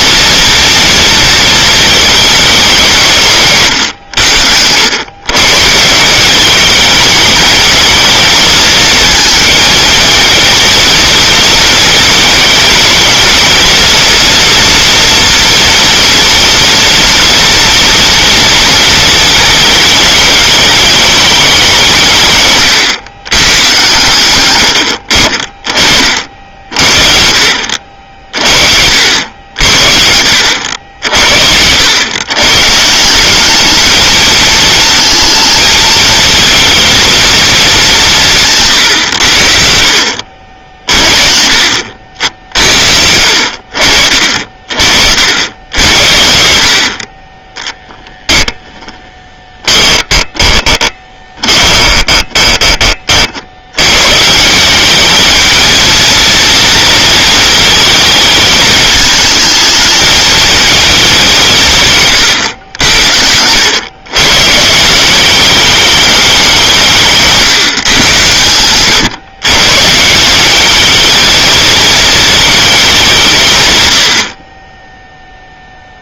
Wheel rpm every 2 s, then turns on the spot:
230, 190, 90, 210, 220, 230, 220, 230, 230, 230, 220, 130, 70, 70, 60, 70, 160, 230, 230, 130, 50, 60, 60, 40, 10, 20, 30, 200, 230, 220, 220, 90, 170, 160, 120, 220, 200, 0.
48-52